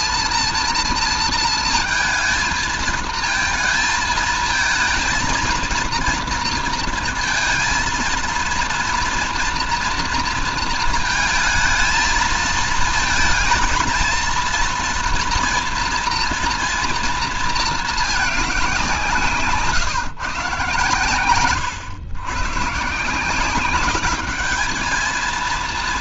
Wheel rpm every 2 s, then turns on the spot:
230, 220, 230, 230, 230, 230, 220, 230, 230, 190, 130, 130, 210.
none